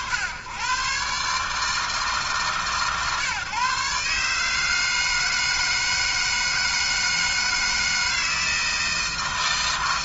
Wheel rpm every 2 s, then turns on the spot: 100, 140, 160, 160, 160.
none